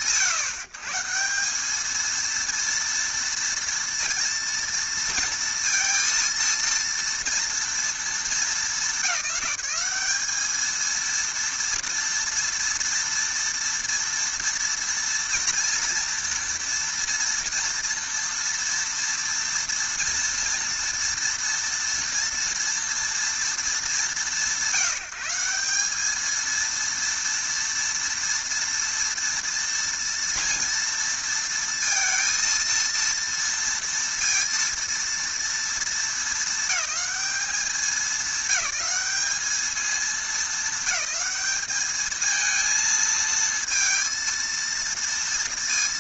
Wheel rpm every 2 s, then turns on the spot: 120, 230, 230, 230, 200, 220, 230, 230, 230, 230, 230, 230, 190, 230, 230, 230, 230, 230, 200, 200, 220, 220, 230.
none